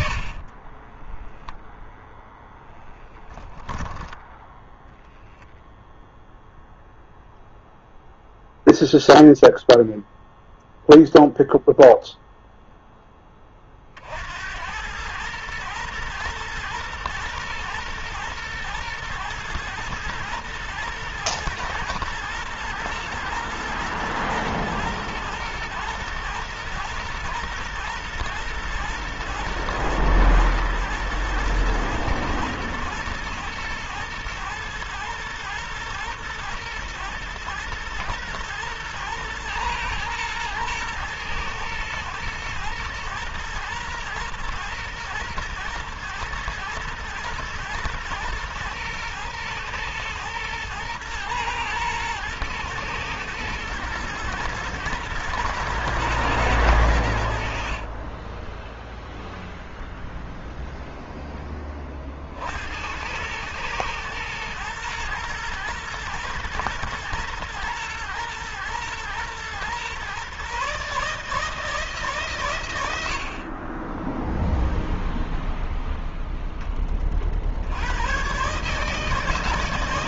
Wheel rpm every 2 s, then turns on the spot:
10, 10, 0, 0, 0, 0, 10, 100, 110, 110, 110, 110, 120, 120, 110, 110, 110, 110, 110, 110, 110, 110, 110, 120, 110, 110, 110, 110, 90, 0, 0, 100, 120, 120, 120, 150, 70, 0, 40, 150.
0-2 56-58